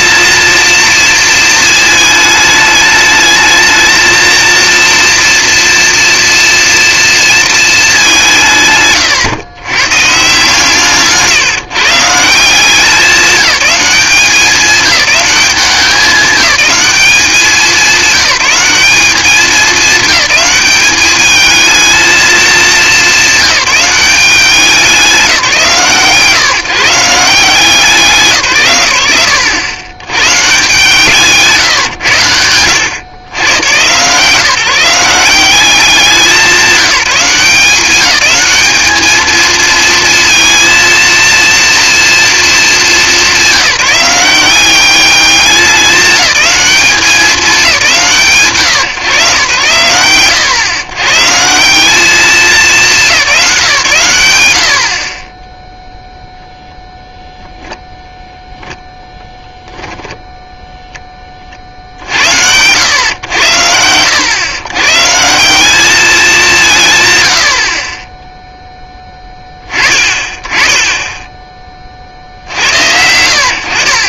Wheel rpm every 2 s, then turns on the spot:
230, 210, 230, 230, 170, 140, 170, 190, 200, 200, 210, 220, 190, 150, 140, 150, 100, 170, 190, 210, 230, 230, 190, 190, 130, 110, 200, 90, 0, 0, 0, 90, 110, 180, 0, 20, 90.
none